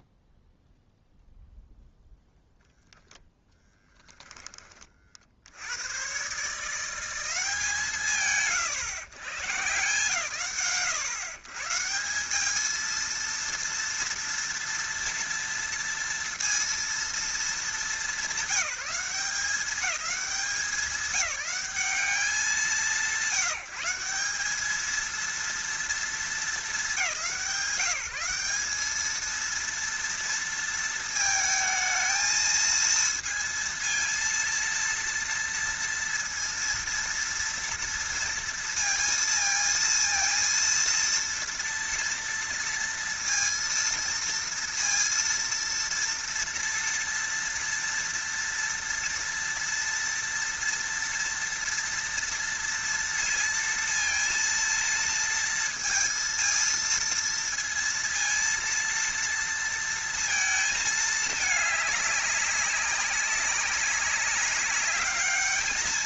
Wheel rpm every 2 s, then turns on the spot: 0, 0, 20, 130, 120, 90, 210, 230, 230, 190, 200, 180, 210, 190, 200, 230, 230, 230, 230, 230, 230, 230, 230, 230, 230, 230, 230, 230, 230, 230, 230, 200, 200.
none